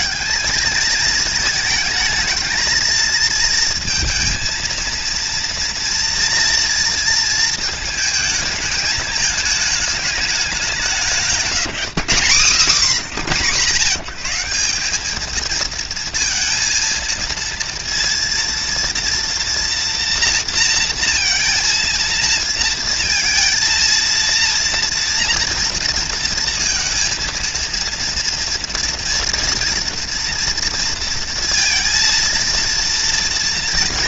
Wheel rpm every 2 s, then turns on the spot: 220, 230, 230, 230, 210, 190, 140, 190, 220, 230, 230, 230, 240, 230, 230, 230, 230.
none